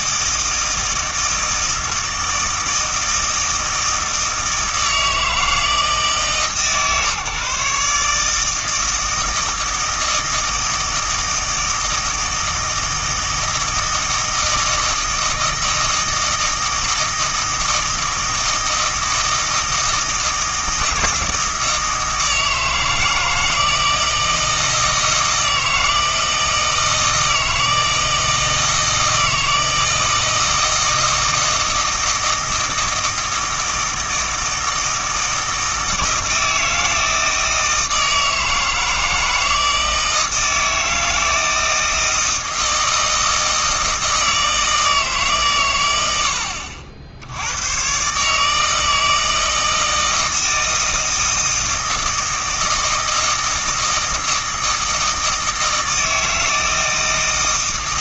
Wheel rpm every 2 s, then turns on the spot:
160, 160, 160, 140, 160, 160, 160, 160, 160, 160, 160, 160, 160, 160, 160, 160, 160, 160, 160, 160, 160, 160, 160, 70, 160, 160, 160, 160, 160.
none